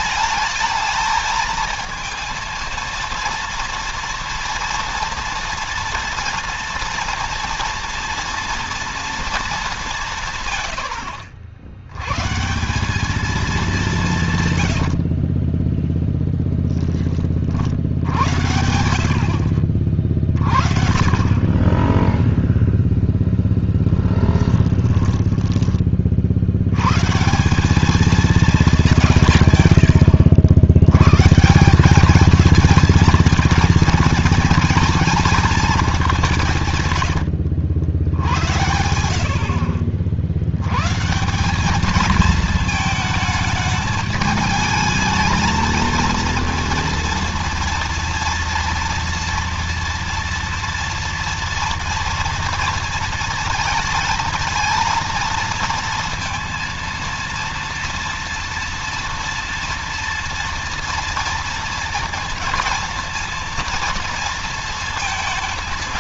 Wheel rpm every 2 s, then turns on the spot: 210, 230, 240, 230, 230, 110, 190, 90, 10, 50, 40, 0, 10, 110, 180, 100, 230, 230, 140, 80, 120, 220, 220, 230, 230, 230, 230, 230, 230, 230, 230, 230, 230.
14-16 24-26